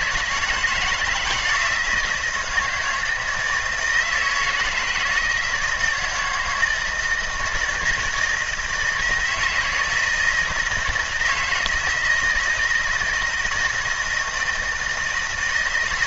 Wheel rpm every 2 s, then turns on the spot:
170, 160, 160, 160, 170, 160, 160, 160.
none